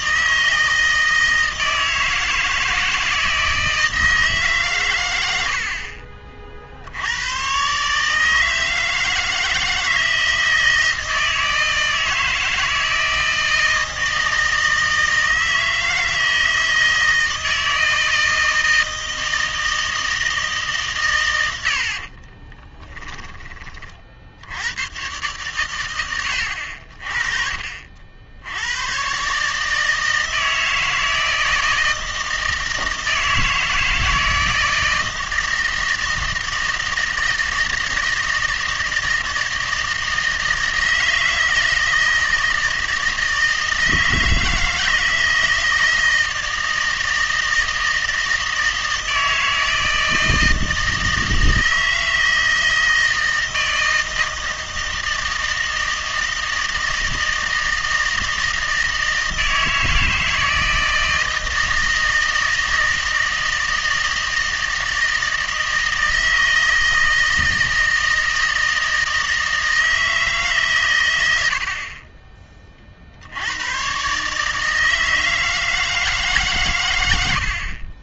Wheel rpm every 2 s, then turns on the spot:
160, 160, 130, 60, 160, 160, 160, 160, 160, 160, 150, 20, 100, 70, 100, 160, 160, 160, 160, 160, 160, 160, 160, 160, 160, 160, 160, 160, 160, 160, 160, 160, 160, 160, 160, 140, 30, 160, 130.
22-24